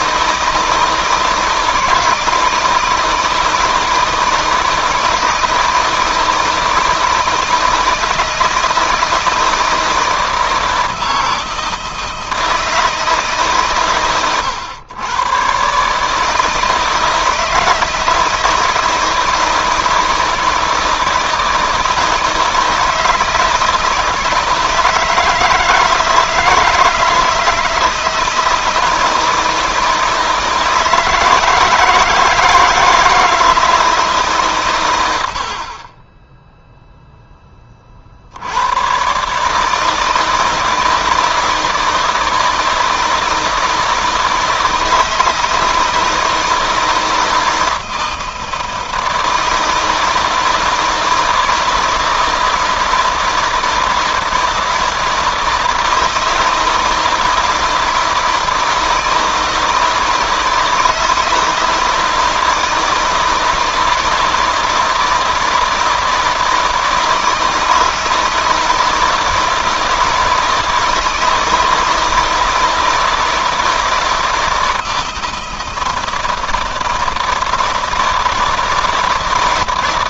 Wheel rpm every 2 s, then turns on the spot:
160, 160, 160, 160, 160, 160, 160, 120, 160, 160, 160, 160, 160, 160, 160, 160, 160, 100, 0, 120, 160, 160, 160, 160, 160, 160, 160, 160, 160, 160, 160, 160, 160, 160, 160, 160, 160, 160, 160, 160.
none